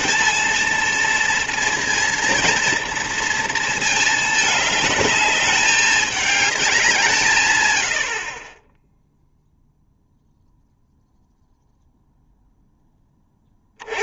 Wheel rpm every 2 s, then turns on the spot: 230, 230, 210, 200, 20, 0, 0.
8-10